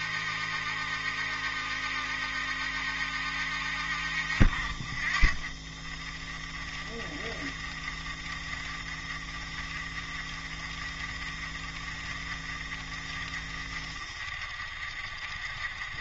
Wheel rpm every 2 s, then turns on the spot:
70, 70, 50, 20, 20, 30, 30, 30.
none